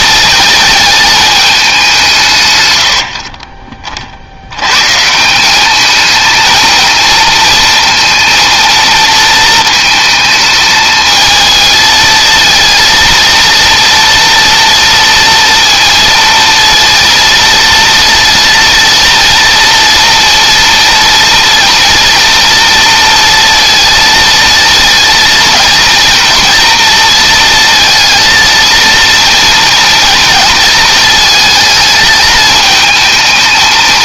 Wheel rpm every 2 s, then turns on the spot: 220, 80, 160, 230, 230, 220, 230, 230, 230, 230, 230, 230, 230, 230, 230, 220, 220.
none